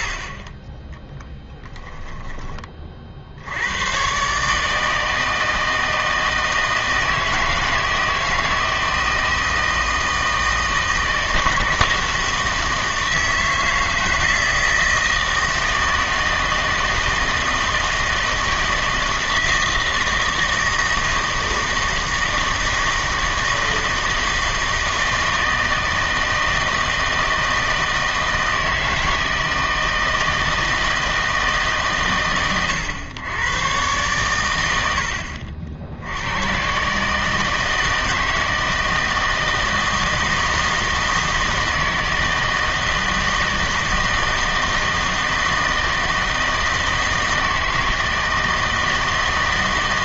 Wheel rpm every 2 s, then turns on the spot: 20, 30, 150, 160, 160, 160, 160, 160, 160, 160, 160, 160, 160, 160, 160, 160, 110, 90, 120, 160, 160, 160, 160, 160, 160.
none